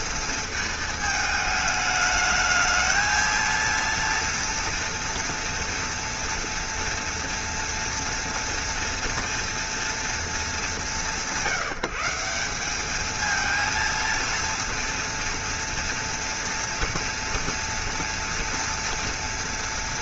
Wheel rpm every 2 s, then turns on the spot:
220, 220, 230, 230, 230, 200, 200, 230, 230, 230.
none